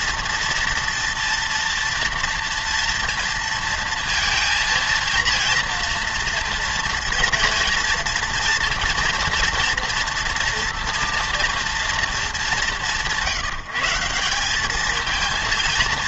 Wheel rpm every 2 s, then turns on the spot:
230, 230, 230, 230, 230, 230, 200, 210.
none